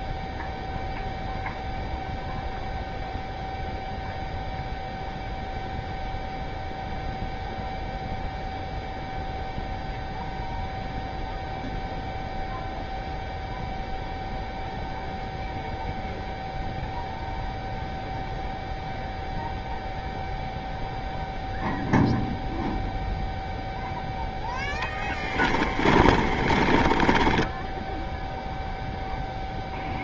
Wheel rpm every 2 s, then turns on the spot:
0, 0, 0, 0, 0, 0, 0, 0, 0, 0, 0, 0, 10, 20, 0.
24-28